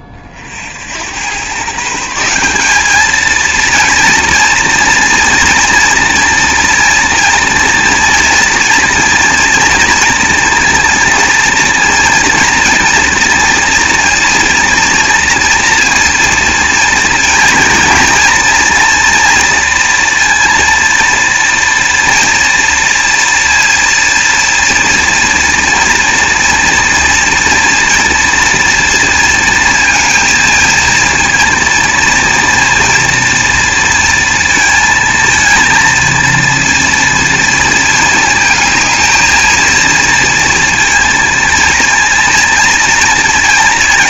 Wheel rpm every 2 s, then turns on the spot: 70, 200, 230, 230, 230, 230, 230, 240, 230, 230, 230, 230, 230, 230, 230, 230, 230, 230, 230, 220, 230, 230.
none